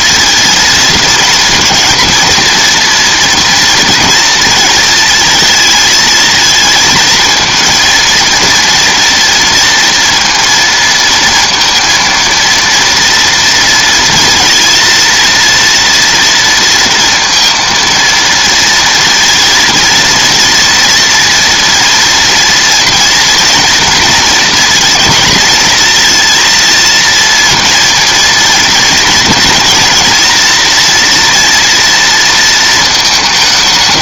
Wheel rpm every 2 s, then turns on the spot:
230, 230, 220, 220, 230, 230, 230, 230, 230, 230, 230, 230, 230, 230, 230, 230, 220.
none